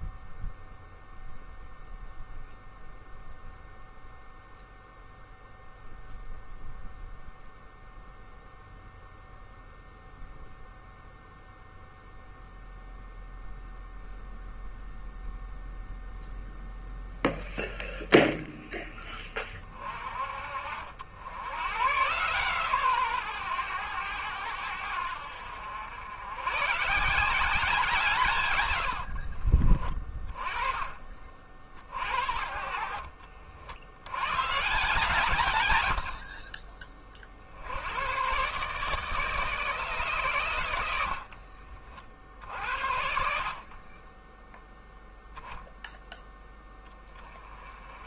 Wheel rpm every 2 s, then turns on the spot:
0, 0, 0, 0, 0, 0, 0, 0, 0, 10, 60, 130, 90, 140, 90, 30, 50, 130, 40, 140, 80, 50, 0, 10.
28-30 40-42